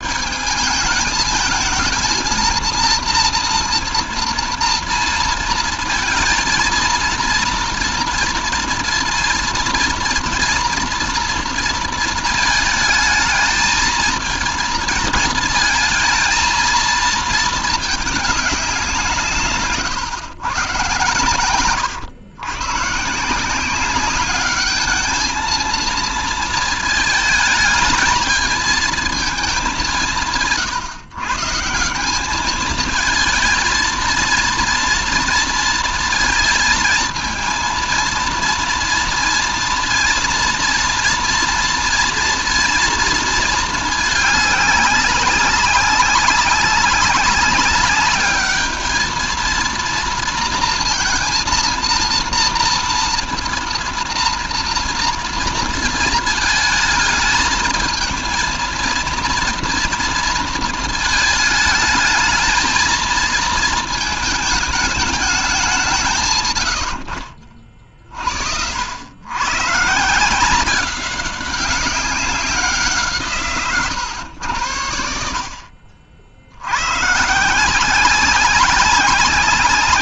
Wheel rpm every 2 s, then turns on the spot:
210, 230, 230, 220, 230, 230, 220, 220, 230, 190, 120, 120, 210, 220, 220, 170, 210, 230, 230, 230, 230, 230, 210, 200, 210, 230, 230, 230, 220, 230, 230, 220, 220, 120, 60, 170, 190, 100, 80, 190.
none